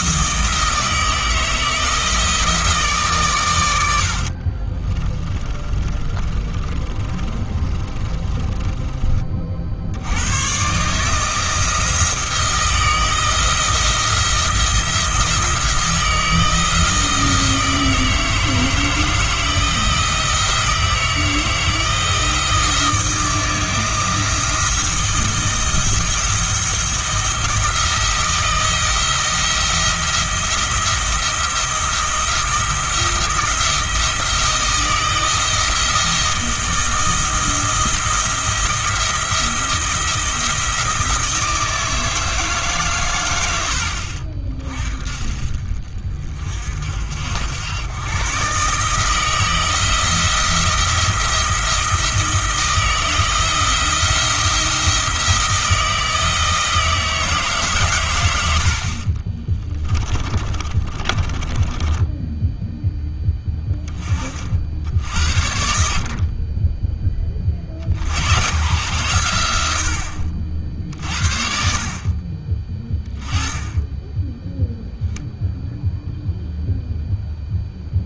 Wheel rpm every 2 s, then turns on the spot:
160, 160, 30, 30, 20, 140, 160, 170, 160, 160, 160, 170, 160, 170, 170, 170, 170, 160, 170, 170, 170, 140, 50, 60, 150, 170, 160, 170, 160, 60, 30, 10, 70, 20, 120, 70, 20, 0, 0.
4-10 60-62